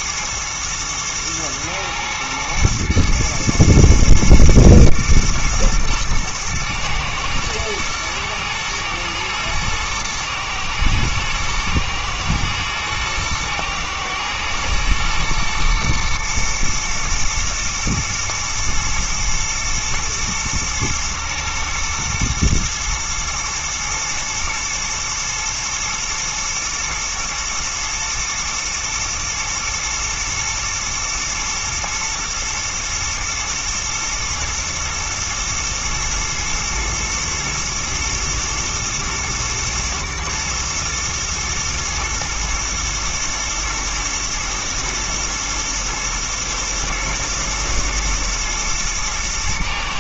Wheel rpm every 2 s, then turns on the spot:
120, 110, 120, 110, 110, 110, 110, 110, 120, 120, 110, 120, 120, 110, 110, 110, 110, 120, 110, 110, 120, 120, 110, 110, 110.
none